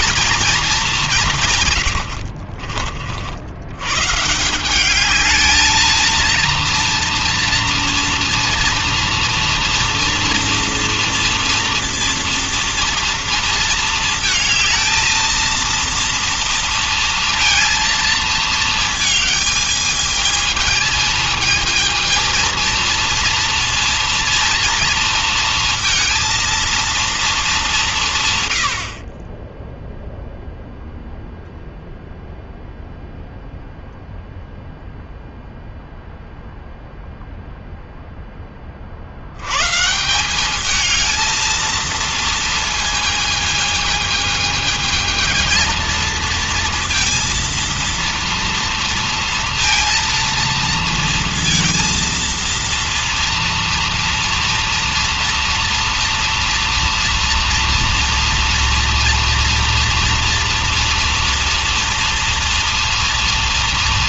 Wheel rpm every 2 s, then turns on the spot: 180, 60, 210, 230, 230, 240, 230, 230, 230, 220, 220, 230, 230, 220, 50, 0, 0, 0, 0, 80, 220, 220, 230, 230, 230, 230, 230, 230, 230, 230, 230, 230.
none